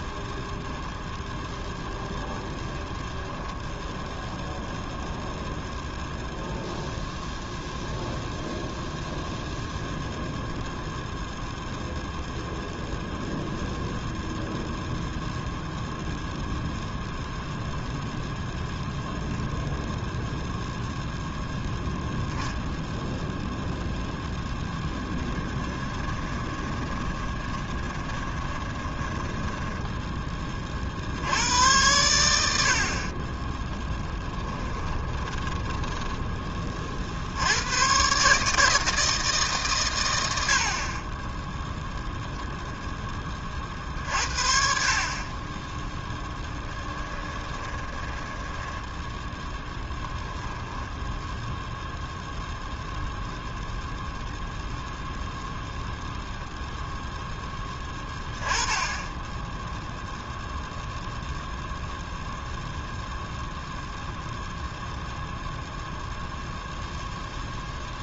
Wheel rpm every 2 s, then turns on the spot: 0, 0, 0, 0, 0, 0, 0, 0, 0, 0, 0, 0, 10, 20, 20, 40, 70, 10, 30, 150, 80, 0, 50, 20, 10, 0, 0, 0, 0, 20, 0, 0, 0, 0.
24-30 34-36 46-50